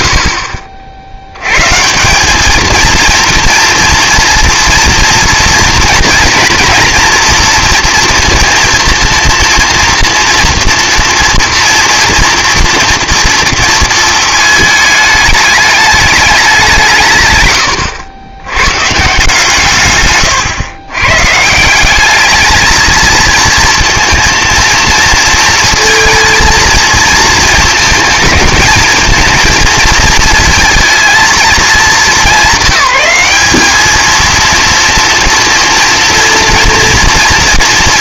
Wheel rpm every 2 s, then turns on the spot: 100, 230, 230, 230, 230, 230, 230, 210, 140, 160, 140, 230, 230, 220, 220, 220, 200, 230, 230.
none